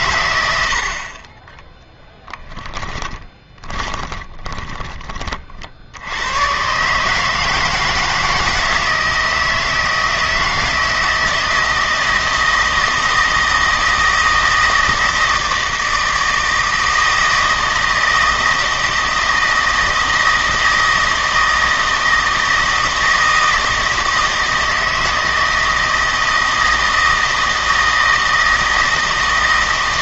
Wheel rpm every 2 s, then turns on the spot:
70, 10, 10, 140, 160, 160, 160, 160, 160, 160, 160, 160, 160, 160, 160.
2-4